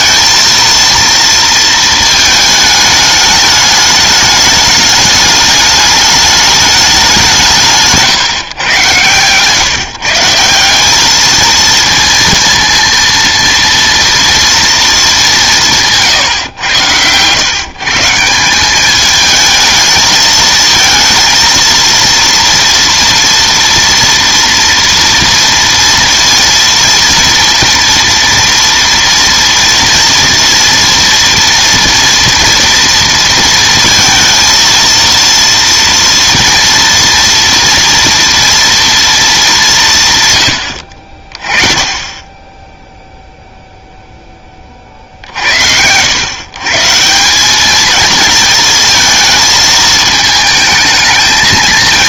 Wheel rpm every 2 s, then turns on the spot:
230, 210, 210, 210, 140, 200, 230, 230, 110, 190, 220, 230, 230, 230, 230, 230, 230, 220, 230, 230, 100, 10, 30, 130, 220, 220.
none